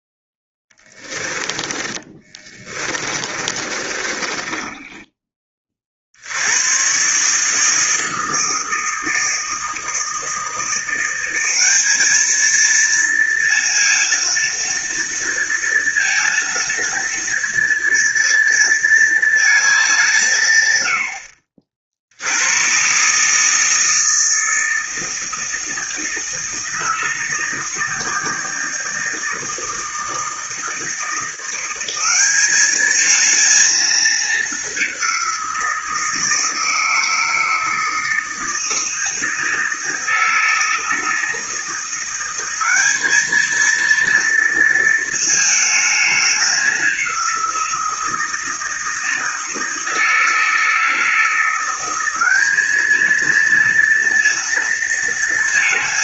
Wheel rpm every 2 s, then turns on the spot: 10, 20, 30, 70, 160, 160, 220, 230, 230, 230, 160, 80, 160, 160, 160, 160, 200, 210, 160, 160, 160, 180, 230, 210, 160, 160, 190, 230.
0-6